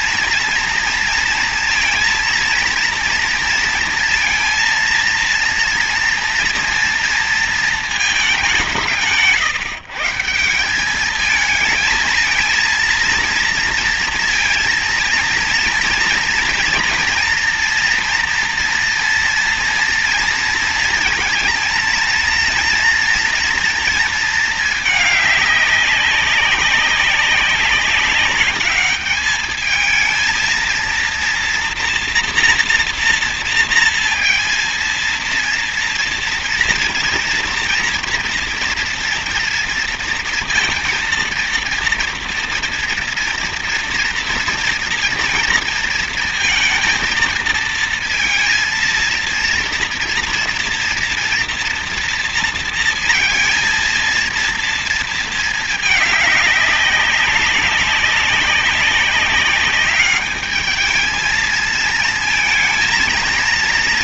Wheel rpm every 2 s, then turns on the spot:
230, 230, 230, 230, 170, 180, 230, 230, 240, 240, 230, 230, 210, 190, 210, 230, 230, 230, 230, 230, 230, 230, 230, 230, 230, 230, 230, 230, 200, 200, 220, 230.
none